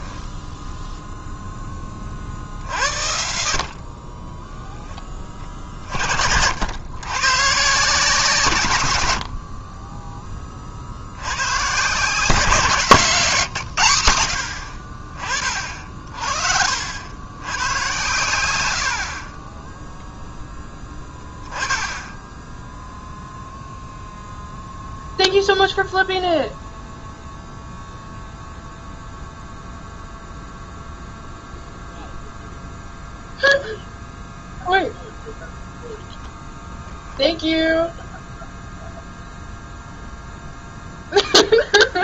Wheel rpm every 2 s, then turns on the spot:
0, 60, 10, 100, 110, 60, 160, 50, 70, 60, 10, 0, 0, 0, 0, 0, 0, 0, 0, 0, 0.
none